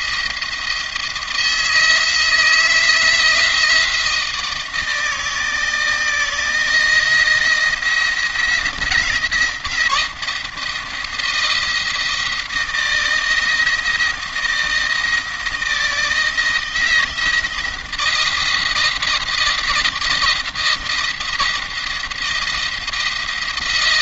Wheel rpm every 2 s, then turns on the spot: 170, 160, 160, 170, 170, 160, 170, 170, 160, 160, 160, 170.
none